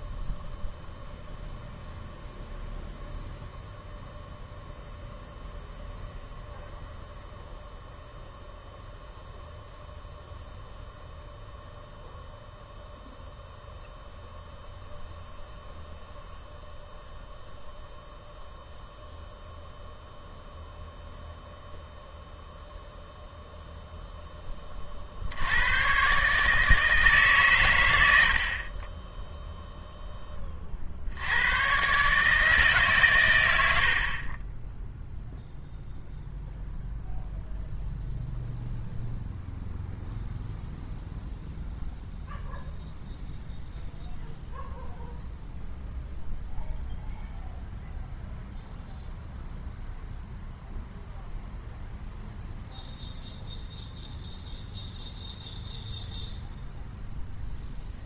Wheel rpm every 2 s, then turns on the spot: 0, 0, 0, 0, 0, 0, 0, 0, 0, 0, 0, 0, 20, 150, 30, 30, 150, 20, 0, 0, 0, 0, 0, 0, 0, 0, 0, 0, 0.
none